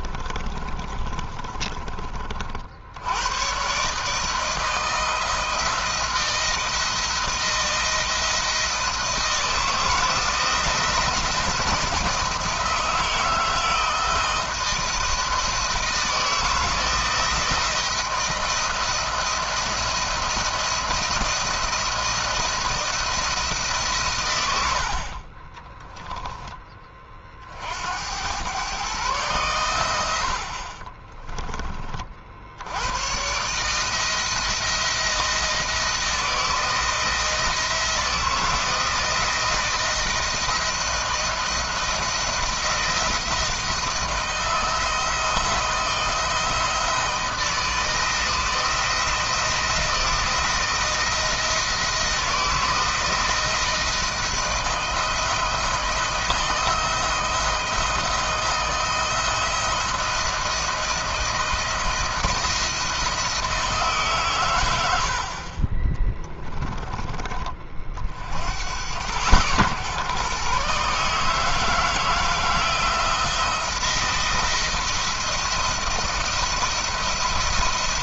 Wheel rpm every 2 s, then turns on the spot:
30, 60, 160, 160, 160, 160, 160, 160, 160, 160, 160, 160, 60, 40, 130, 30, 100, 170, 170, 160, 160, 160, 160, 160, 160, 170, 160, 160, 160, 160, 170, 170, 90, 30, 90, 140, 170, 160, 170.
0-2 30-32